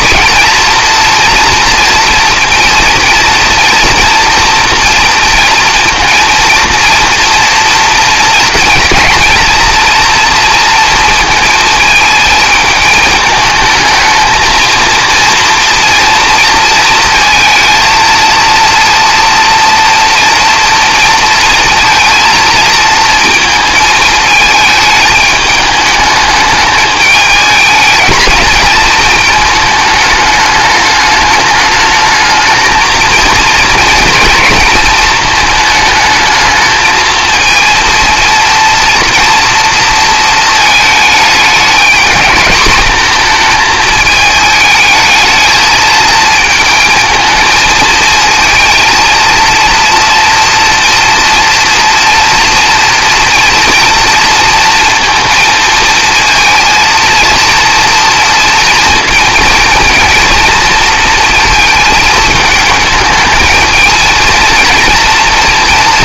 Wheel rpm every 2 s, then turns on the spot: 230, 240, 240, 230, 230, 230, 220, 230, 230, 230, 230, 230, 220, 210, 220, 210, 220, 220, 220, 230, 220, 220, 220, 220, 230, 230, 230, 230, 230, 230, 230, 220, 230.
none